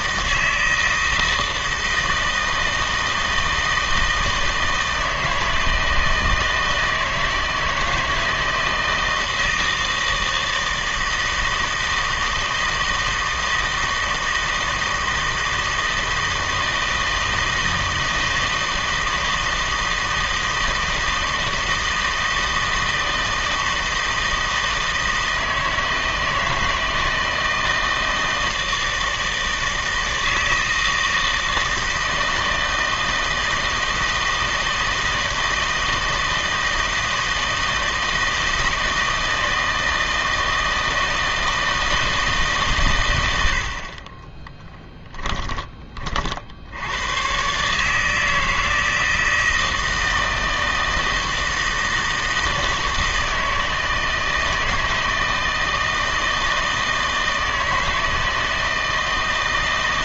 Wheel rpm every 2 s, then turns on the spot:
160, 160, 160, 160, 160, 160, 160, 160, 160, 160, 160, 160, 160, 160, 160, 160, 160, 160, 160, 160, 160, 130, 10, 70, 160, 160, 160, 160, 160, 160.
44-46